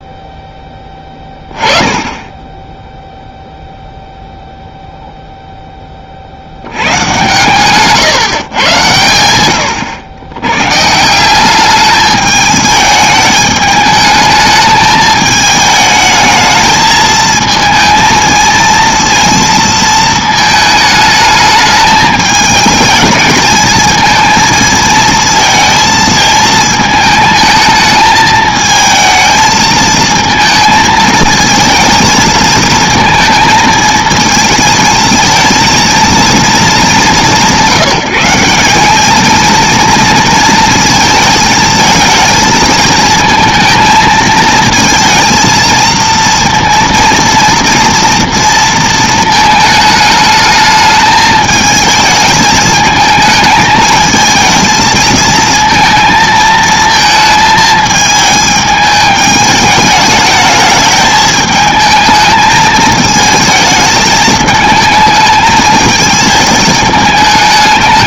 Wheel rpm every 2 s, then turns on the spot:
10, 30, 0, 80, 120, 120, 210, 220, 220, 230, 220, 220, 220, 220, 220, 220, 230, 220, 190, 190, 230, 220, 220, 230, 230, 220, 220, 220, 220, 210, 210, 220, 220, 220.
none